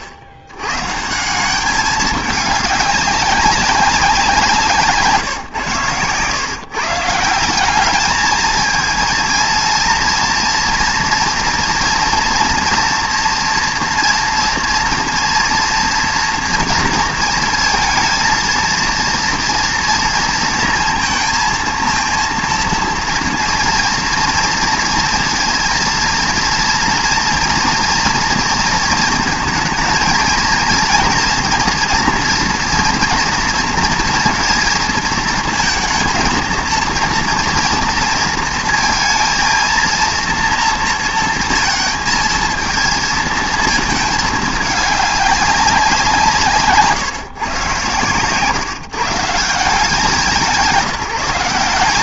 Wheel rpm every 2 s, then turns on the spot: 90, 200, 160, 140, 220, 230, 230, 230, 230, 230, 230, 230, 230, 230, 230, 230, 230, 230, 230, 230, 230, 220, 210, 160, 140, 180.
4-6